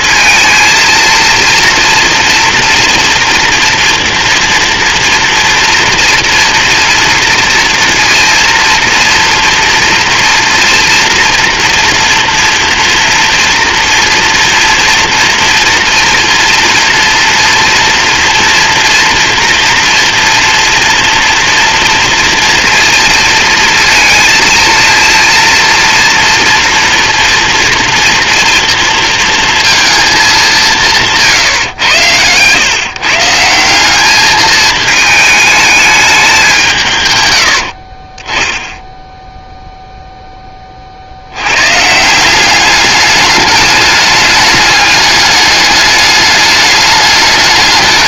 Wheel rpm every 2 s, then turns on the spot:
230, 230, 230, 230, 230, 230, 230, 230, 230, 230, 230, 230, 230, 240, 230, 180, 130, 220, 190, 10, 30, 200, 200, 210.
none